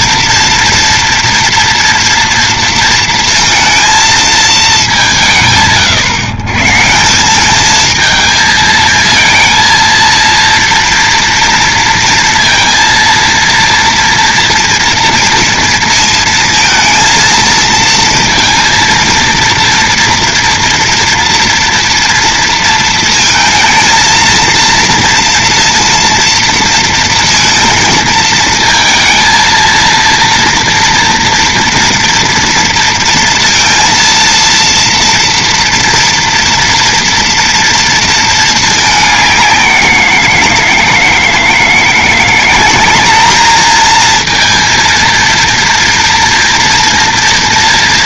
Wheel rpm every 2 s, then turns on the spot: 230, 230, 220, 130, 220, 230, 230, 230, 230, 230, 240, 230, 230, 230, 230, 230, 230, 230, 230, 210, 160, 190, 230, 230.
none